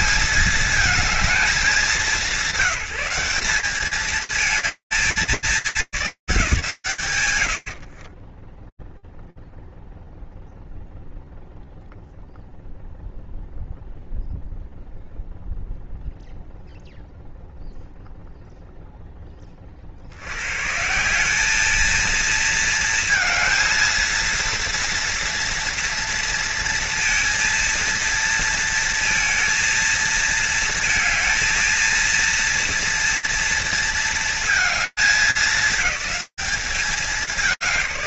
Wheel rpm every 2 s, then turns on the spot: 210, 190, 220, 170, 10, 0, 0, 0, 0, 20, 190, 220, 230, 230, 230, 230, 230, 200, 180.
none